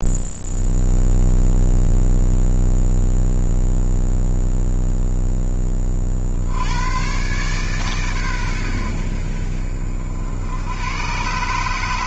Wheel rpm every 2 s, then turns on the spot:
0, 0, 0, 80, 110, 80.
none